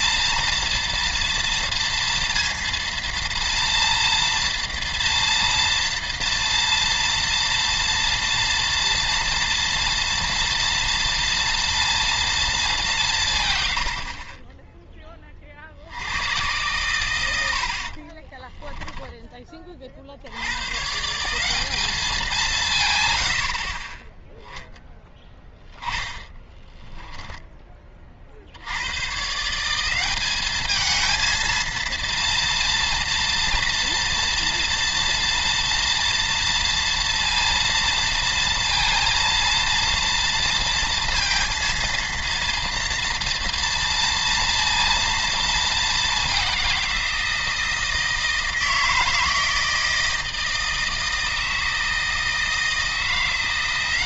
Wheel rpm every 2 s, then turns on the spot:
230, 230, 240, 230, 230, 230, 210, 10, 110, 10, 130, 160, 10, 20, 90, 220, 230, 230, 230, 230, 230, 230, 230, 180, 160, 160, 160.
18-20 26-28